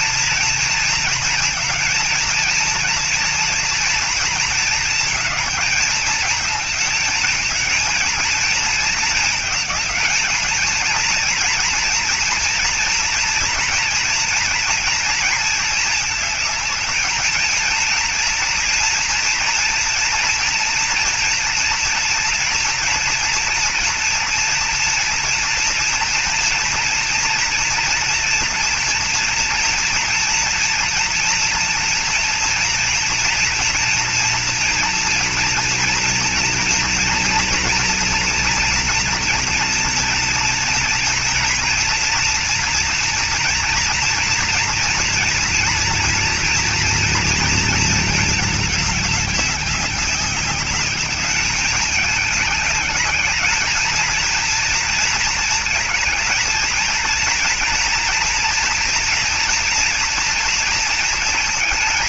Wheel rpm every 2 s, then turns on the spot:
230, 230, 230, 220, 230, 220, 230, 230, 220, 230, 230, 230, 230, 230, 240, 230, 240, 240, 240, 230, 230, 230, 230, 230, 220, 200, 200, 230, 220, 230, 230.
none